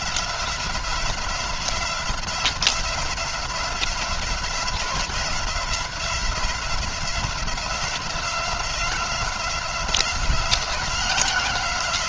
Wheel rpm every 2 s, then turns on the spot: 180, 180, 180, 180, 180, 180.
none